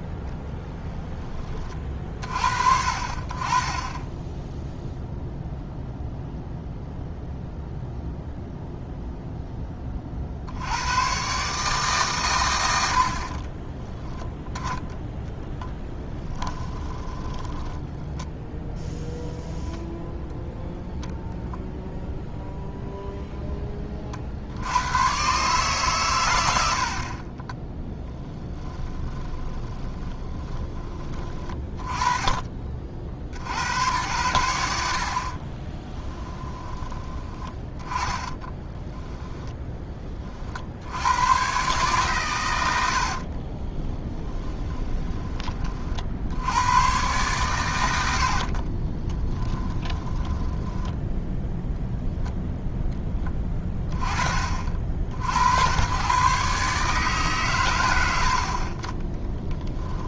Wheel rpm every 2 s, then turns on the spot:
10, 50, 0, 0, 0, 90, 60, 10, 20, 0, 0, 0, 90, 70, 20, 30, 40, 80, 20, 10, 50, 100, 20, 100, 40, 20, 10, 40, 140, 30.
16-18 28-32 38-40 44-46 48-52